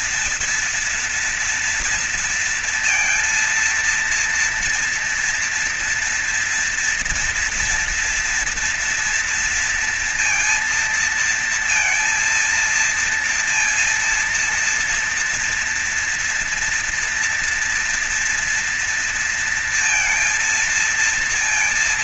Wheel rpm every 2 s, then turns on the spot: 240, 230, 230, 240, 230, 230, 230, 230, 230, 230, 230.
none